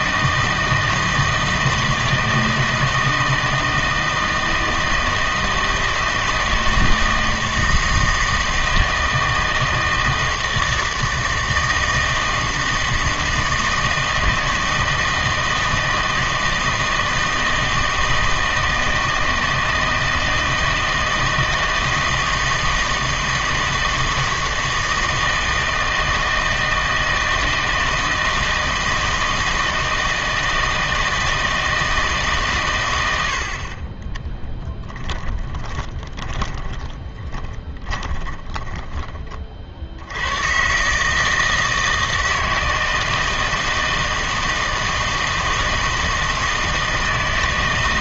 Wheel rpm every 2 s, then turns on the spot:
160, 160, 160, 160, 160, 160, 160, 160, 160, 160, 160, 160, 160, 160, 160, 160, 120, 10, 10, 20, 120, 160, 160, 160.
34-40